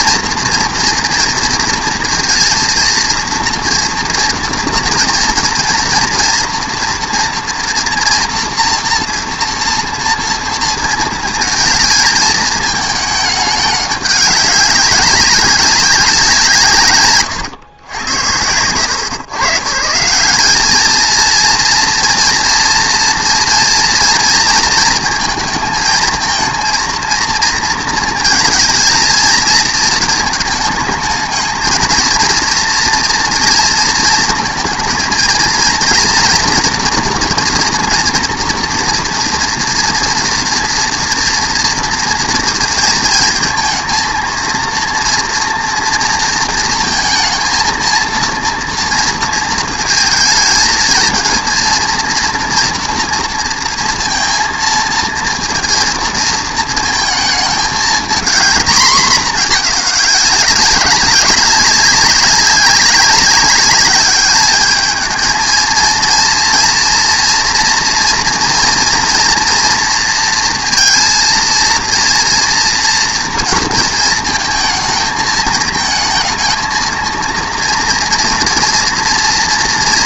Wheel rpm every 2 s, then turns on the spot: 230, 230, 230, 230, 230, 230, 220, 200, 150, 90, 200, 230, 230, 230, 230, 220, 230, 230, 230, 230, 230, 230, 230, 230, 230, 220, 230, 230, 230, 230, 200, 200, 210, 230, 230, 230, 230, 220, 230, 230.
none